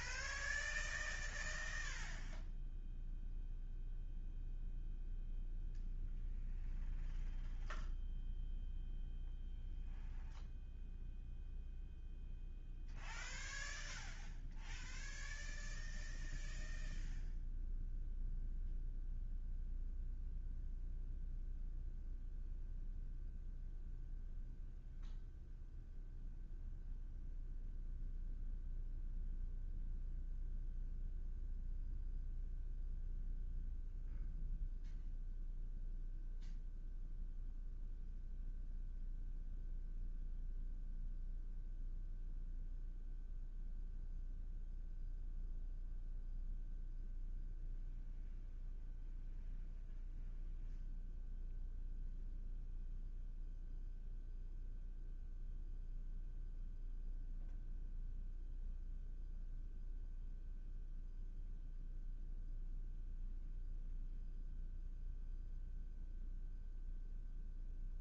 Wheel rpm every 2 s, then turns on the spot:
0, 0, 0, 0, 0, 0, 0, 0, 0, 0, 0, 0, 0, 0, 0, 0, 0, 0, 0, 0, 0, 0, 0, 0, 0, 0, 0, 0, 0, 0, 0, 0, 0, 0.
none